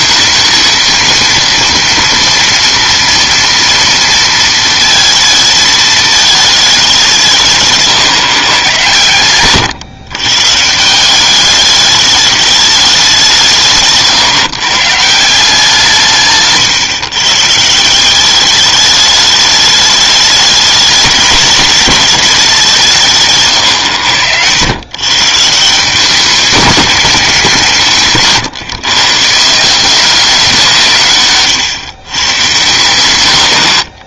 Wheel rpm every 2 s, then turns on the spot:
230, 230, 230, 210, 130, 150, 210, 140, 140, 200, 200, 190, 100, 200, 140, 180, 120.
16-18